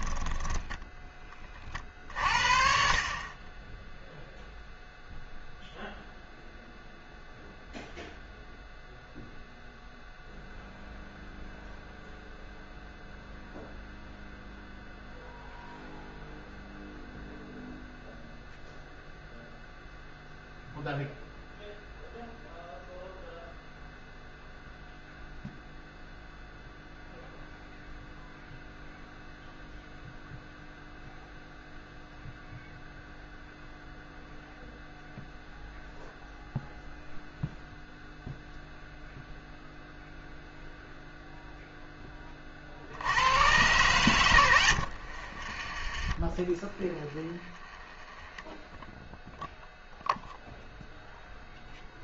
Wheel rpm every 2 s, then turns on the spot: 10, 50, 0, 0, 0, 0, 0, 0, 0, 0, 0, 0, 0, 0, 0, 0, 0, 0, 0, 0, 0, 60, 80, 20, 0, 0.
0-2 44-48